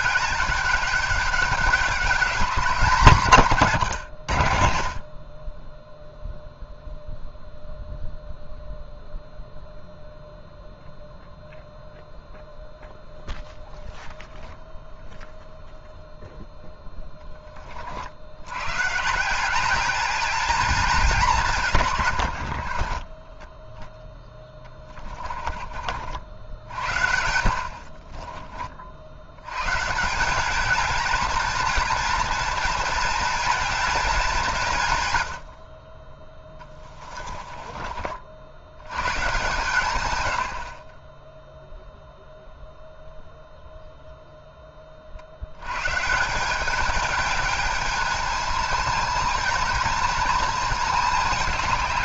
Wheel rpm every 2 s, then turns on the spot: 200, 200, 80, 0, 0, 0, 0, 0, 0, 100, 210, 60, 20, 60, 40, 210, 230, 170, 20, 80, 60, 0, 20, 190, 220, 220.
22-26 36-38